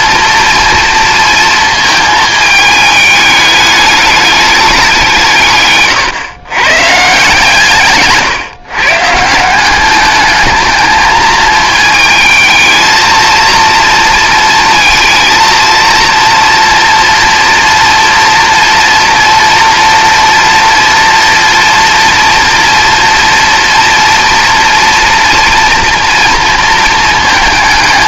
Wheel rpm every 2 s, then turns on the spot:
230, 220, 200, 130, 140, 220, 220, 230, 230, 230, 240, 230, 230, 230.
none